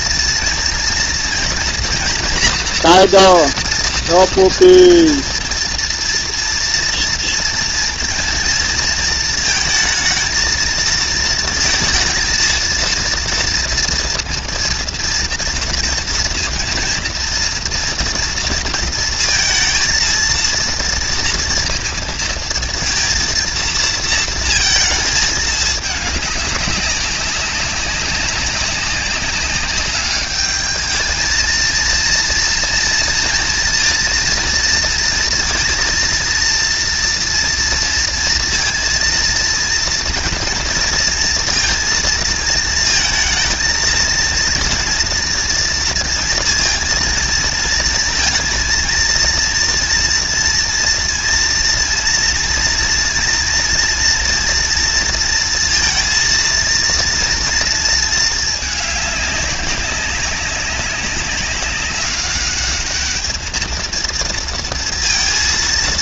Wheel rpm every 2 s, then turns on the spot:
230, 230, 230, 230, 230, 230, 230, 230, 230, 230, 230, 230, 230, 210, 200, 200, 230, 230, 230, 230, 240, 230, 230, 230, 230, 230, 230, 240, 230, 220, 200, 200, 230.
none